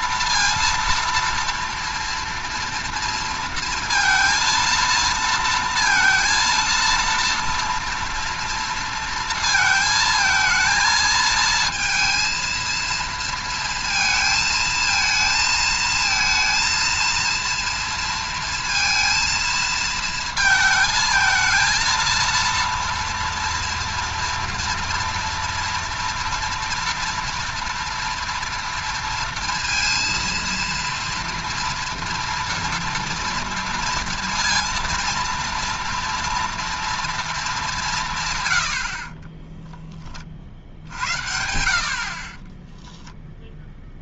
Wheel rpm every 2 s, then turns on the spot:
230, 230, 230, 230, 230, 220, 230, 220, 230, 230, 220, 230, 230, 230, 230, 230, 230, 230, 230, 100, 60, 20.
38-40 42-44